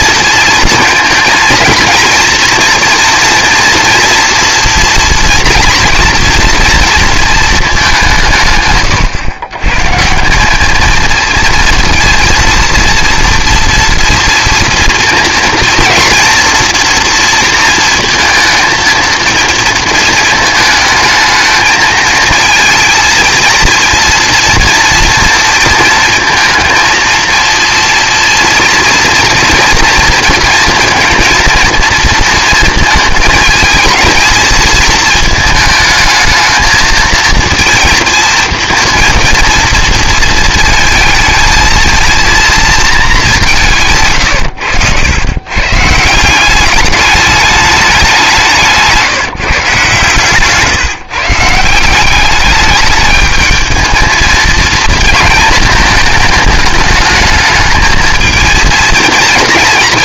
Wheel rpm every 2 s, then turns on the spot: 220, 230, 230, 230, 130, 210, 230, 230, 230, 230, 220, 230, 230, 220, 230, 230, 220, 220, 220, 230, 230, 230, 100, 200, 170, 150, 210, 230, 220, 230.
none